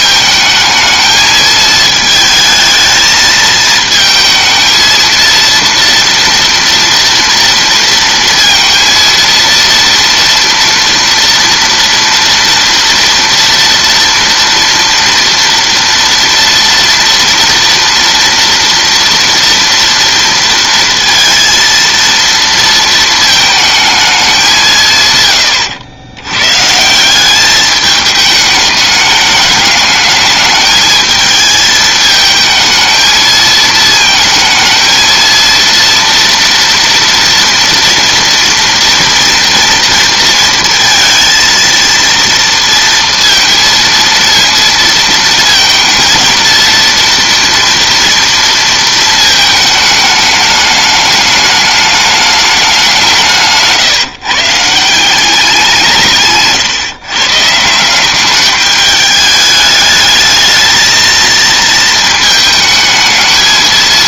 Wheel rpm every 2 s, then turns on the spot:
220, 220, 220, 230, 230, 230, 230, 230, 240, 240, 230, 230, 180, 140, 210, 220, 220, 220, 230, 230, 230, 230, 230, 230, 230, 210, 200, 160, 140, 210, 220, 220.
none